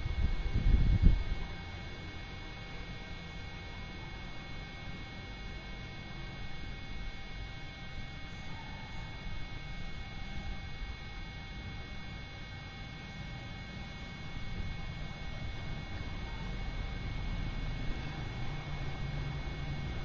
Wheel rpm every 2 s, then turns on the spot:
0, 0, 0, 0, 0, 0, 0, 0, 0, 0.
none